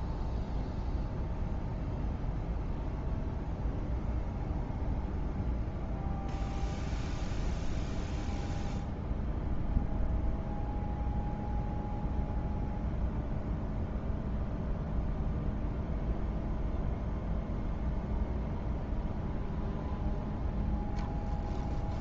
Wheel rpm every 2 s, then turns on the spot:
0, 0, 0, 0, 0, 0, 0, 0, 0, 0, 0.
none